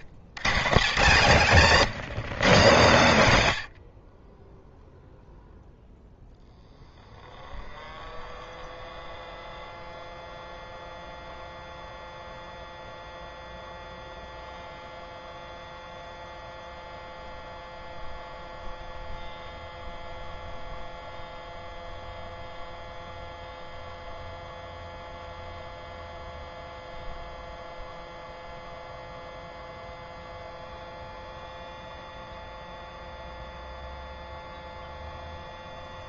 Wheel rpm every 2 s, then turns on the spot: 120, 140, 10, 0, 0, 0, 0, 0, 0, 0, 0, 0, 0, 0, 0, 0, 0, 0.
none